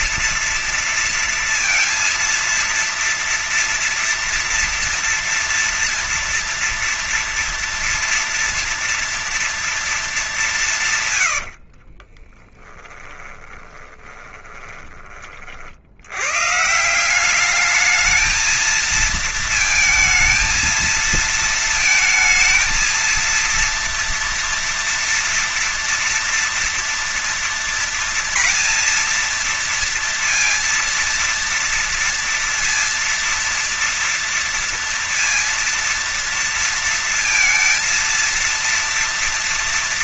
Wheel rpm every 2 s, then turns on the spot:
230, 230, 230, 230, 230, 170, 20, 20, 130, 220, 230, 220, 230, 240, 230, 230, 230, 230, 230, 230.
12-16